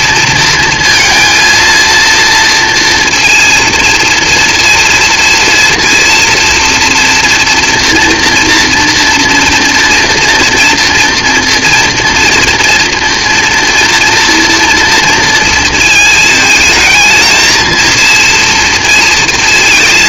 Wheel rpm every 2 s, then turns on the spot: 230, 230, 230, 230, 240, 230, 230, 230, 220, 230.
none